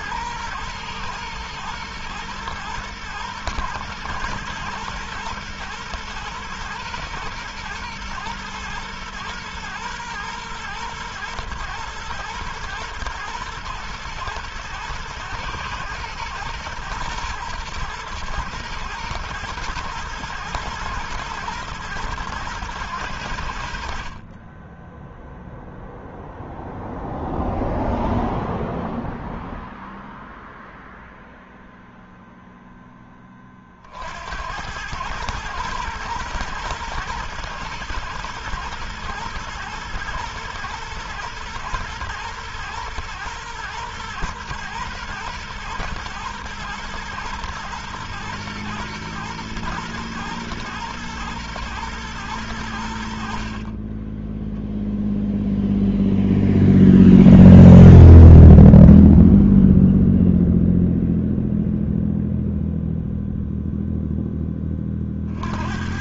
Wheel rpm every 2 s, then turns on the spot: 110, 110, 120, 120, 110, 110, 110, 110, 120, 120, 110, 100, 10, 0, 0, 0, 10, 100, 110, 110, 120, 120, 120, 110, 120, 110, 80, 0, 0, 0, 0, 0, 30.
none